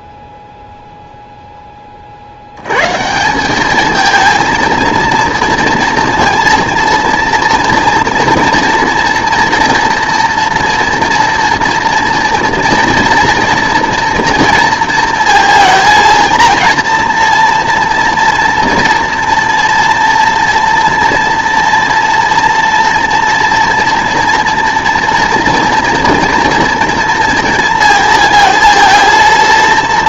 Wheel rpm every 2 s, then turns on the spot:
0, 100, 230, 230, 230, 230, 230, 230, 240, 230, 230, 230, 230, 230, 230.
none